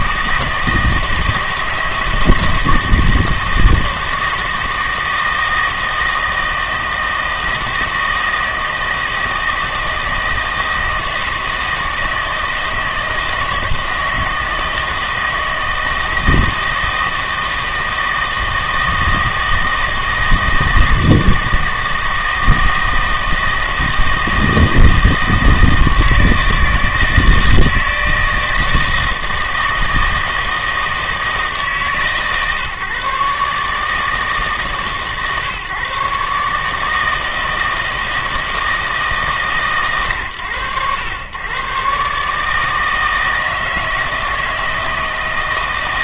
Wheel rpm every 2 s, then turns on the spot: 160, 160, 160, 160, 160, 160, 160, 160, 160, 160, 160, 160, 160, 160, 160, 160, 140, 150, 150, 160, 100, 160, 160.
none